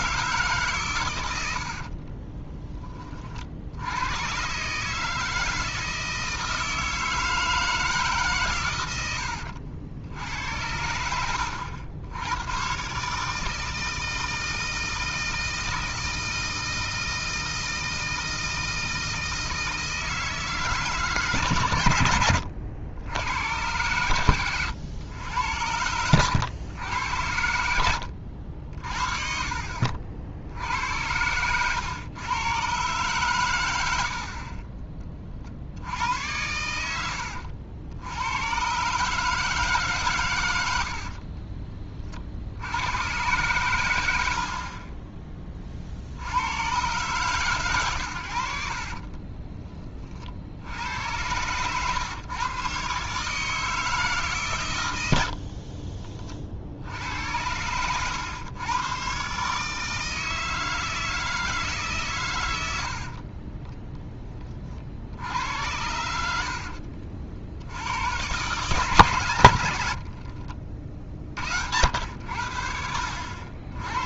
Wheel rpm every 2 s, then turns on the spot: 140, 20, 140, 160, 100, 80, 120, 160, 160, 160, 150, 80, 110, 100, 60, 70, 120, 20, 90, 120, 90, 80, 10, 100, 60, 70, 120, 110, 60, 110, 160, 90, 30, 60, 140, 60, 70.
2-4 70-72